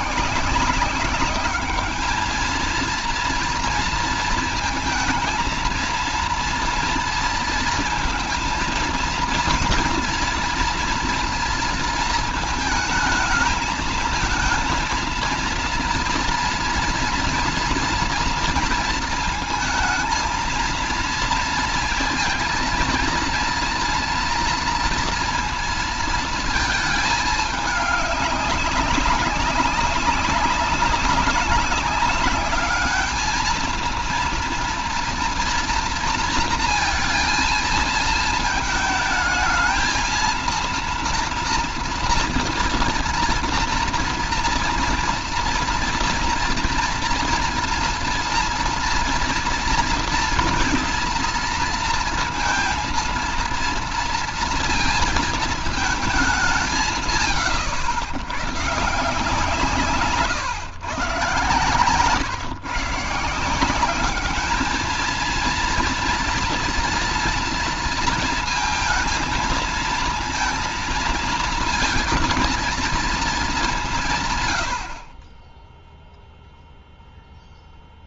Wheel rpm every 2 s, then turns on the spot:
180, 230, 230, 230, 230, 240, 220, 220, 230, 230, 230, 230, 230, 220, 200, 200, 210, 230, 230, 220, 230, 240, 230, 240, 230, 240, 230, 230, 170, 130, 120, 130, 220, 230, 230, 230, 230, 80, 0.
none